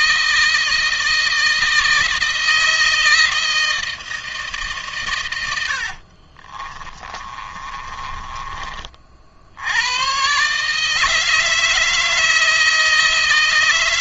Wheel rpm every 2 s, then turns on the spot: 160, 160, 140, 40, 40, 150, 160.
6-8